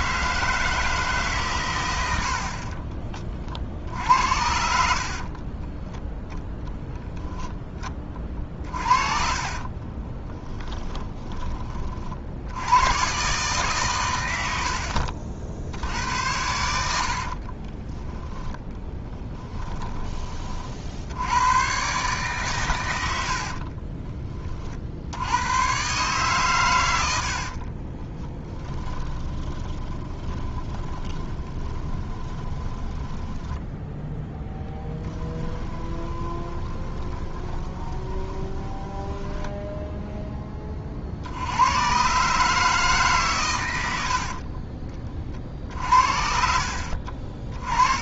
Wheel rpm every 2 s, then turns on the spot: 160, 40, 60, 20, 40, 10, 90, 80, 90, 10, 50, 120, 40, 120, 10, 20, 20, 10, 30, 10, 30, 150, 40, 60.
2-12 18-20 28-40 46-48